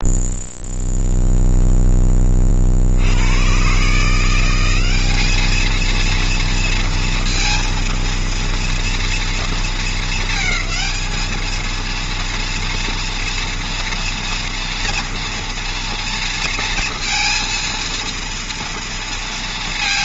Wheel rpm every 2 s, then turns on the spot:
0, 60, 190, 230, 240, 220, 230, 230, 230, 230.
none